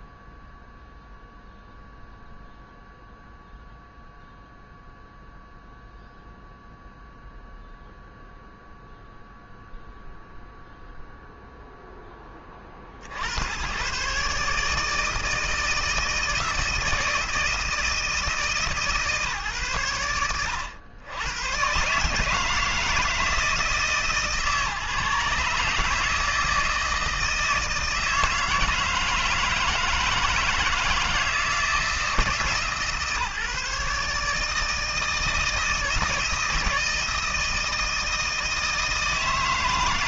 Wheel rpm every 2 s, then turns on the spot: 0, 0, 0, 0, 0, 0, 60, 160, 160, 150, 100, 160, 150, 160, 160, 160, 150, 150, 170, 160.
none